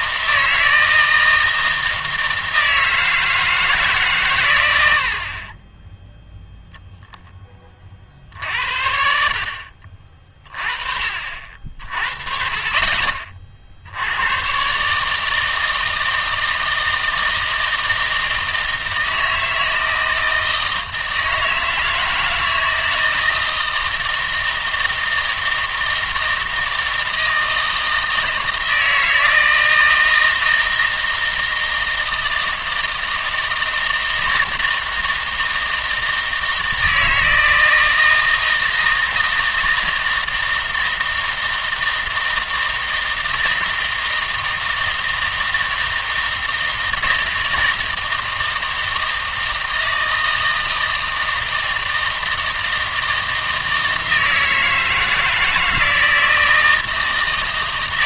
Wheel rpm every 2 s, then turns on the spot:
160, 160, 110, 0, 70, 30, 40, 140, 160, 160, 160, 160, 160, 160, 160, 160, 160, 160, 160, 160, 160, 160, 160, 160, 160, 160, 160, 160, 160.
none